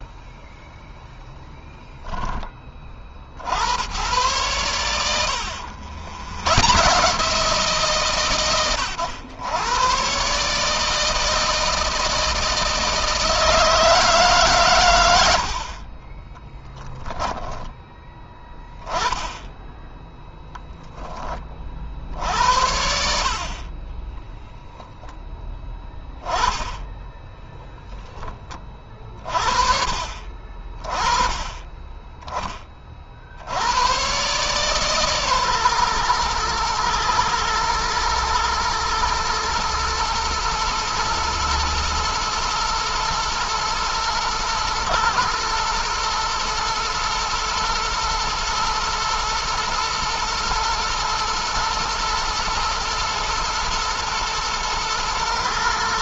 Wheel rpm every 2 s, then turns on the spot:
10, 40, 90, 150, 110, 160, 160, 90, 10, 10, 10, 60, 10, 10, 40, 20, 50, 140, 120, 120, 120, 110, 110, 110, 110, 110, 110, 110.
16-18